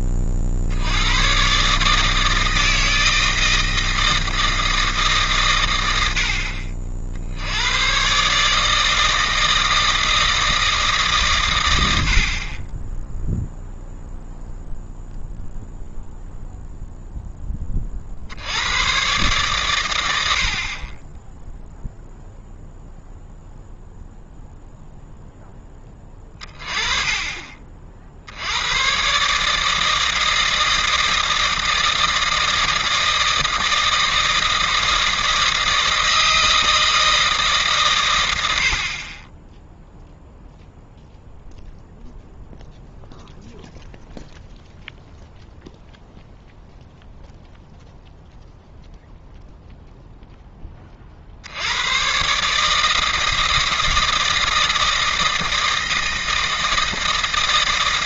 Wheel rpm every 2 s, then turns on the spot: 20, 150, 160, 90, 130, 160, 80, 0, 0, 70, 70, 0, 0, 20, 110, 160, 160, 160, 160, 50, 0, 0, 0, 0, 0, 20, 160, 160, 160.
none